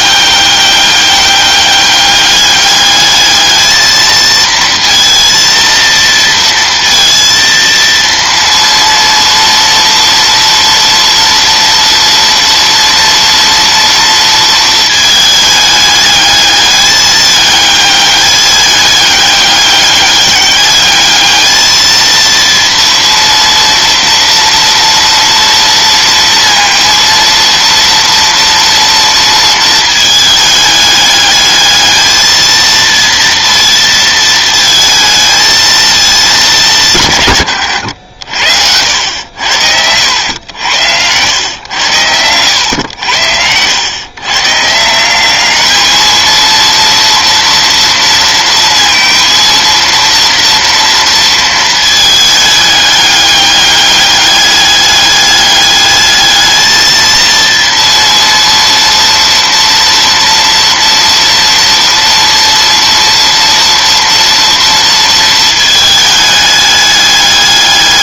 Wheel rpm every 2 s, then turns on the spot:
200, 200, 230, 230, 230, 230, 230, 230, 210, 210, 200, 230, 230, 230, 230, 210, 230, 230, 180, 80, 80, 90, 160, 230, 230, 230, 210, 200, 220, 230, 230, 230, 230, 210.
38-40